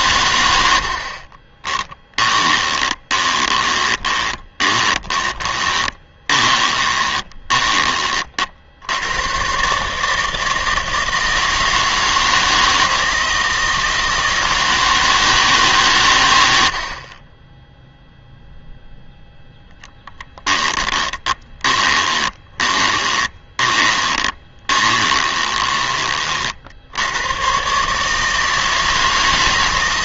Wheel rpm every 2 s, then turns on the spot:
70, 20, 20, 20, 80, 160, 160, 160, 60, 0, 10, 20, 20, 70, 160.
0-8 20-26